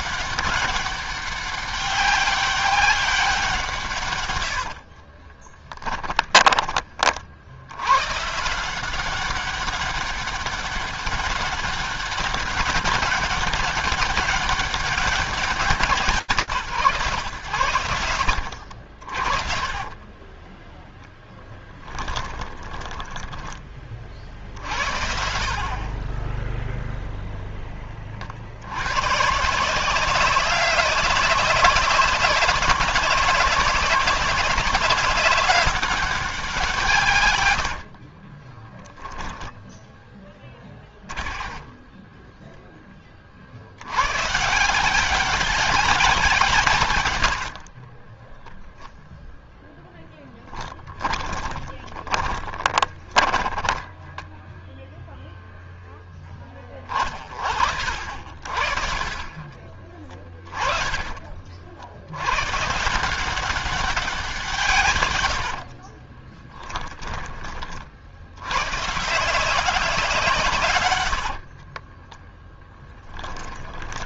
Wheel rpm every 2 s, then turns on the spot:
200, 200, 110, 10, 150, 200, 200, 200, 160, 70, 20, 10, 50, 20, 50, 190, 200, 190, 190, 40, 10, 10, 140, 170, 10, 0, 20, 10, 10, 40, 20, 110, 180, 40, 80, 160, 20.
4-6 18-24 38-44 48-50 52-56 60-62 66-68 72-74